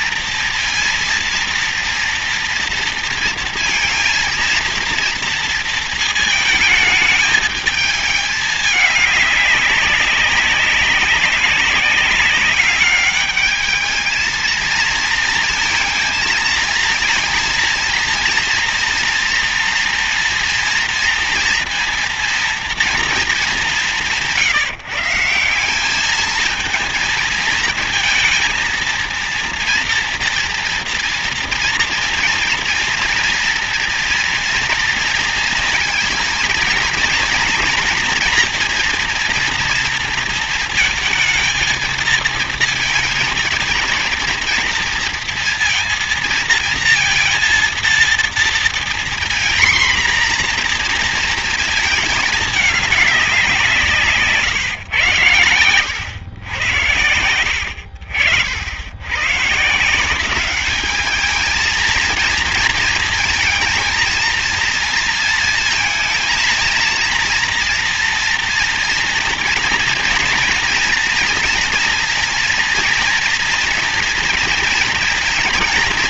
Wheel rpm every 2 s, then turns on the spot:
230, 230, 230, 230, 210, 200, 200, 220, 230, 230, 230, 230, 170, 210, 230, 230, 230, 230, 230, 240, 230, 230, 230, 230, 230, 240, 220, 140, 90, 70, 190, 230, 230, 220, 230, 230, 230, 230.
none